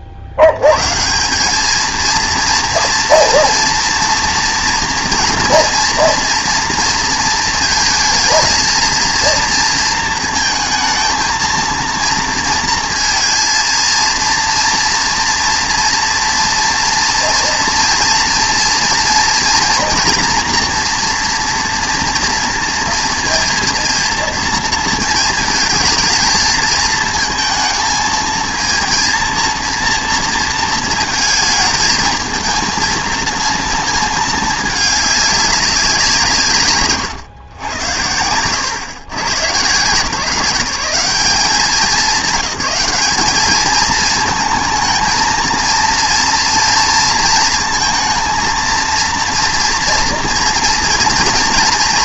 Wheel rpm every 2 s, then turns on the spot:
160, 230, 230, 230, 230, 230, 230, 230, 230, 240, 240, 230, 230, 220, 230, 220, 220, 210, 140, 110, 190, 190, 220, 230, 230, 230.
none